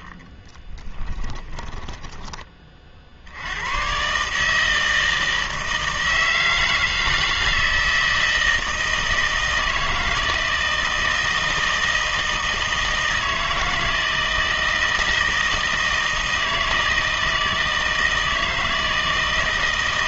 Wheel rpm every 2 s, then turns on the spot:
20, 20, 150, 160, 160, 160, 160, 160, 160, 160.
0-2